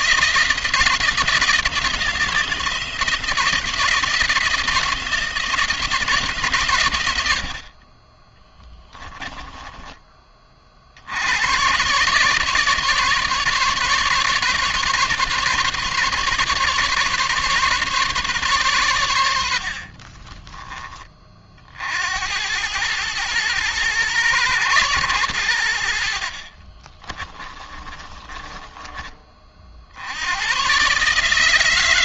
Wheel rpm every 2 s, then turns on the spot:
170, 170, 160, 110, 20, 50, 150, 150, 140, 120, 20, 100, 110, 40, 30, 120.
8-10 26-28